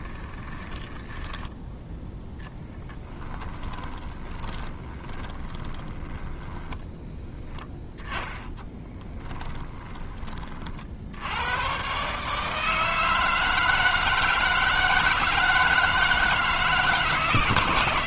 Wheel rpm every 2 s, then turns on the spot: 10, 10, 20, 10, 10, 60, 160, 160, 150.
0-6 8-10